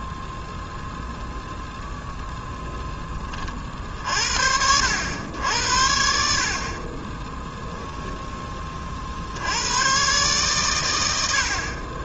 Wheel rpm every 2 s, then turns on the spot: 0, 0, 60, 50, 20, 120.
none